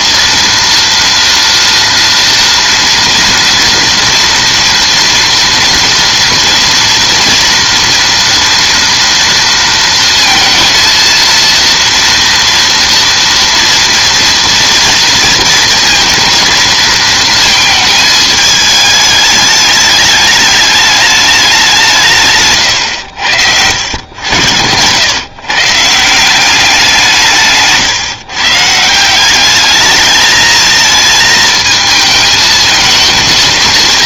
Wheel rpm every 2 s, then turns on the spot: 240, 230, 230, 230, 240, 230, 230, 230, 230, 210, 210, 130, 90, 190, 150, 220, 220.
none